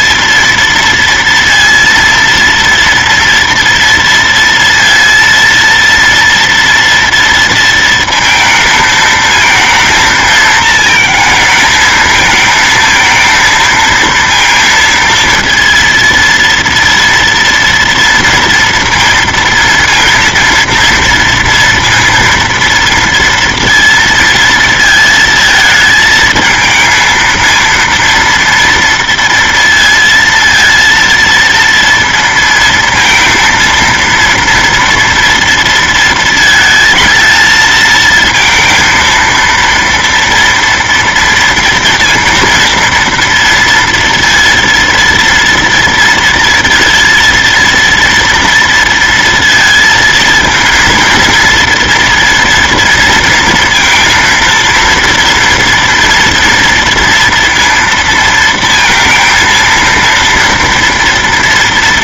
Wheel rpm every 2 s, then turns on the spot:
230, 230, 230, 230, 220, 220, 220, 230, 230, 230, 230, 230, 230, 220, 230, 230, 230, 230, 220, 230, 230, 230, 230, 230, 230, 230, 230, 230, 230, 230, 230.
none